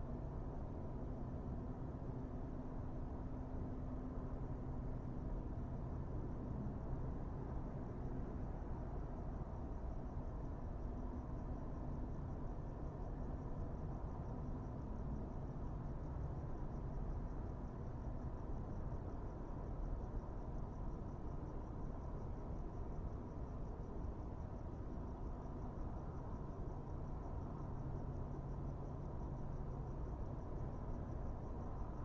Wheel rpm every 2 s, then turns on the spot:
0, 0, 0, 0, 0, 0, 0, 0, 0, 0, 0, 0, 0, 0, 0, 0.
none